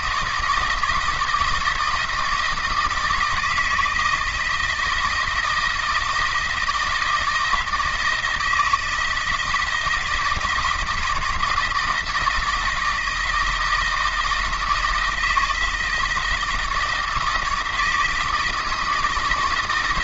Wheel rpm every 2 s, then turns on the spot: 170, 160, 160, 160, 160, 160, 160, 160, 160, 160.
none